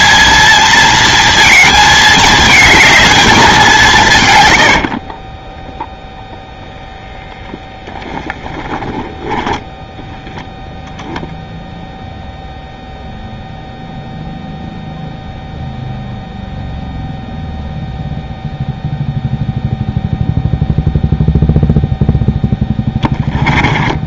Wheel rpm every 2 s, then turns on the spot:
230, 220, 90, 0, 20, 0, 0, 0, 0, 0, 0, 10.
4-6 8-10 22-24